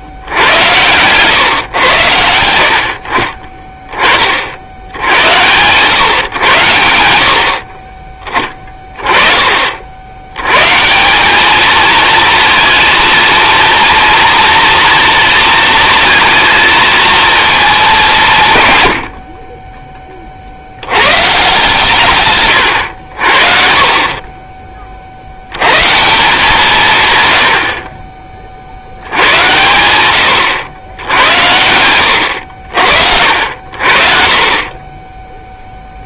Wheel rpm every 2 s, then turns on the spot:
100, 60, 70, 90, 20, 140, 230, 230, 230, 110, 70, 100, 30, 150, 70, 90, 70, 30.
none